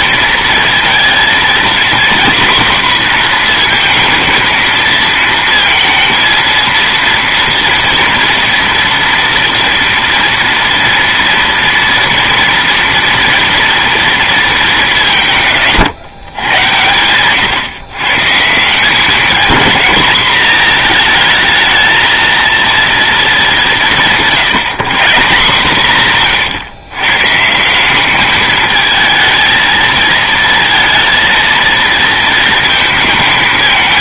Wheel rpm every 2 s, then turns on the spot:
230, 250, 230, 230, 230, 230, 240, 210, 110, 160, 220, 230, 180, 130, 220, 230, 230.
none